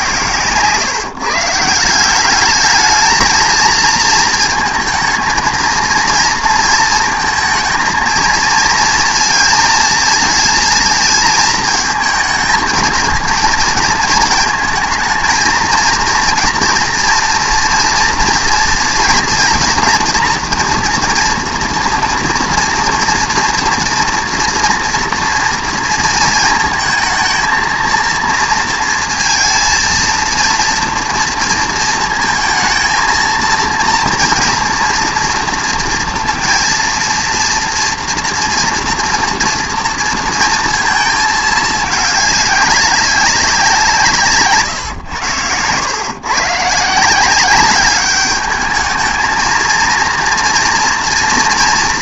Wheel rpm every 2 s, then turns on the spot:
130, 210, 230, 230, 230, 230, 230, 230, 240, 230, 230, 230, 230, 230, 230, 230, 230, 230, 230, 230, 230, 210, 130, 140, 210, 230.
44-46